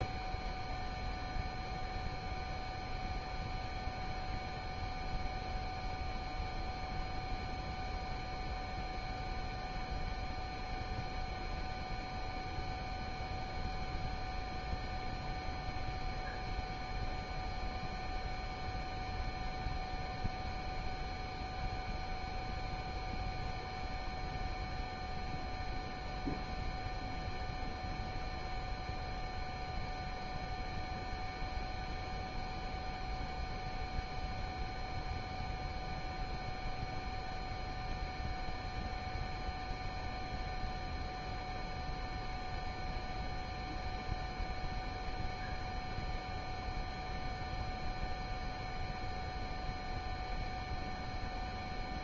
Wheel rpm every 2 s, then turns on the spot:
0, 0, 0, 0, 0, 0, 0, 0, 0, 0, 0, 0, 0, 0, 0, 0, 0, 0, 0, 0, 0, 0, 0, 0, 0, 0.
none